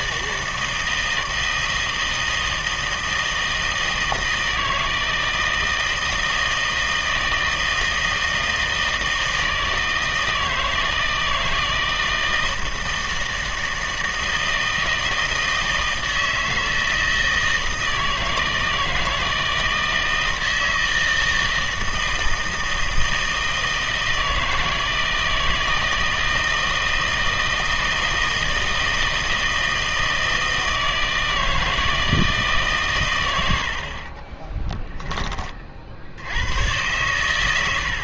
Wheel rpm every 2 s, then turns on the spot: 160, 160, 160, 160, 160, 160, 160, 160, 160, 160, 160, 160, 160, 160, 160, 160, 140, 20, 110.
34-36